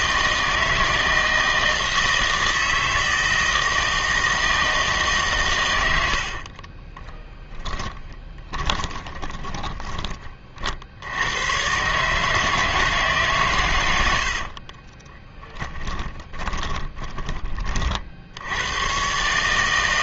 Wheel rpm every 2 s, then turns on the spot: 160, 160, 160, 40, 20, 40, 160, 50, 20, 90.
6-10 14-18